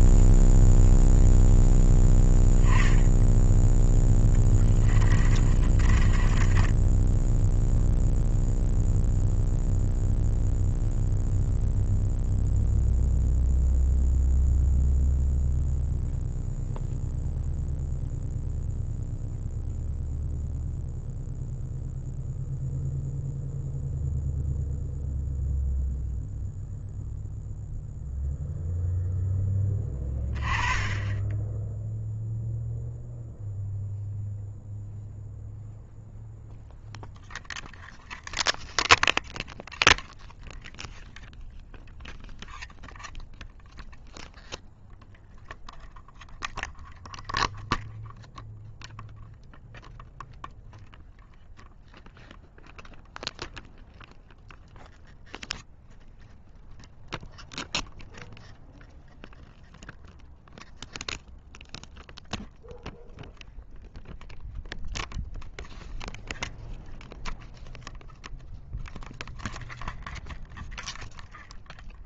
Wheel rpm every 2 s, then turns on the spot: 0, 10, 20, 10, 0, 0, 0, 0, 0, 0, 0, 0, 0, 0, 0, 20, 0, 0, 0, 0, 0, 0, 0, 0, 0, 0, 0, 0, 0, 0, 0, 0, 0, 0, 0, 0.
4-8